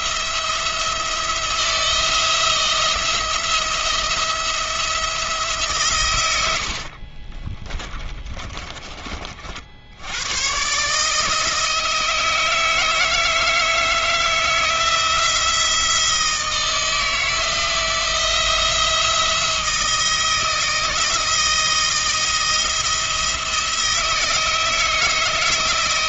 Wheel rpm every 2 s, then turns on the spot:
170, 170, 170, 70, 20, 120, 160, 160, 160, 170, 160, 170, 160.
6-10